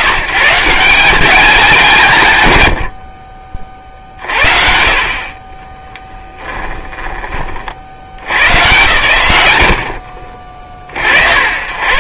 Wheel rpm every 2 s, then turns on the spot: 160, 100, 60, 10, 130, 50.
6-8